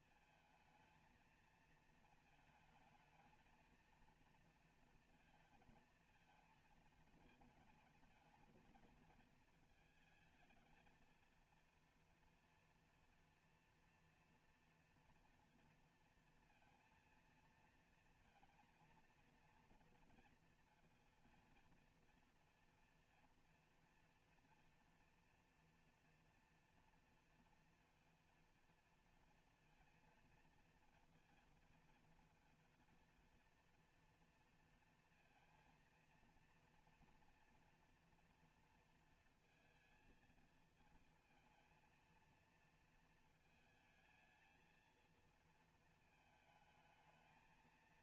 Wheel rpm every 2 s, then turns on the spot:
220, 220, 230, 230, 220, 220, 240, 230, 230, 230, 230, 240, 230, 230, 230, 230, 240, 230, 230, 230, 220, 220, 230, 220.
none